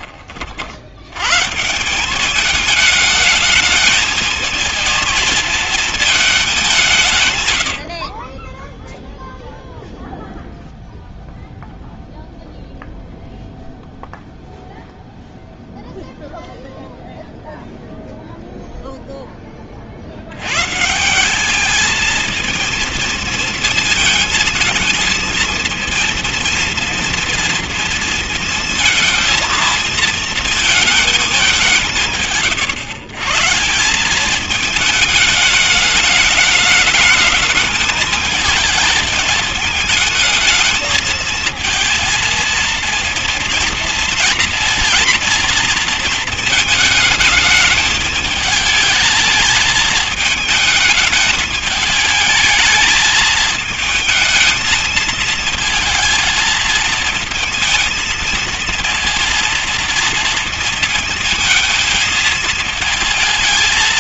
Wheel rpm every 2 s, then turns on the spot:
60, 210, 230, 170, 0, 0, 0, 0, 0, 0, 140, 230, 230, 230, 230, 220, 130, 220, 210, 220, 220, 230, 230, 220, 220, 220, 220, 220, 230, 230, 220, 220.
none